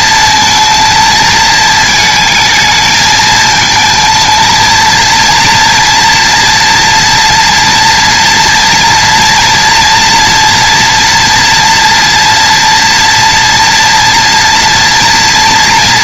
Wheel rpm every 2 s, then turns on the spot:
230, 220, 230, 230, 240, 230, 230, 230.
none